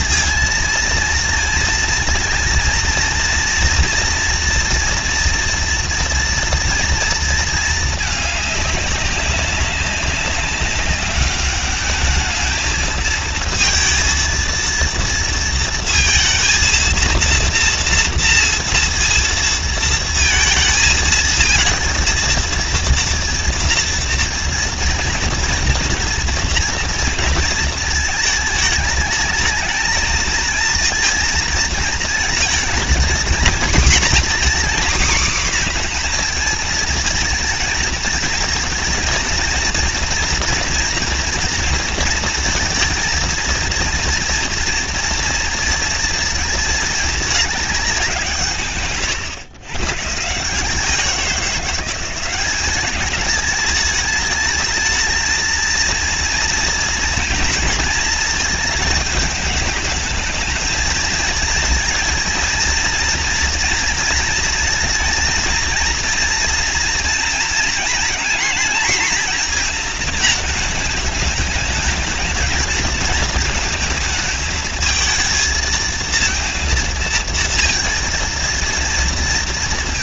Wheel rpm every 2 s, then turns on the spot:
230, 230, 230, 230, 210, 200, 210, 230, 230, 230, 220, 230, 230, 240, 220, 230, 230, 250, 240, 230, 230, 230, 230, 220, 170, 150, 190, 220, 230, 220, 220, 230, 230, 230, 230, 220, 220, 220, 230, 230.
none